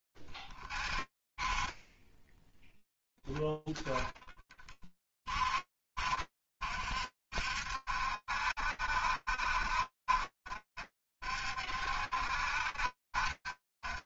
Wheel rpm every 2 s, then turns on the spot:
10, 50, 60, 70, 60, 70, 60.
none